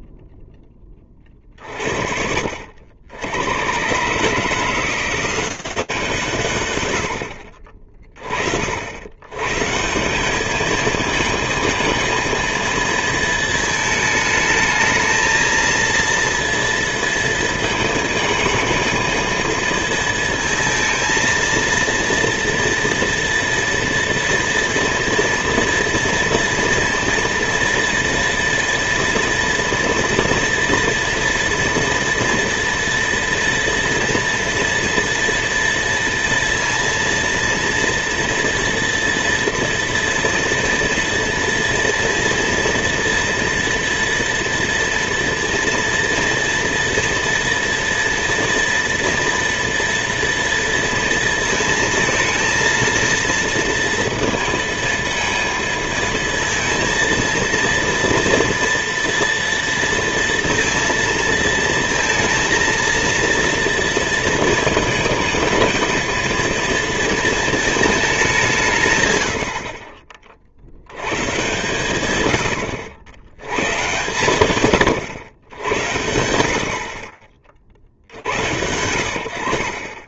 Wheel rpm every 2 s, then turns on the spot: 20, 70, 170, 80, 100, 220, 230, 220, 230, 230, 230, 230, 230, 230, 230, 230, 230, 230, 230, 230, 230, 230, 230, 230, 230, 230, 220, 230, 230, 230, 230, 230, 220, 230, 110, 110, 90, 120, 40, 70.
none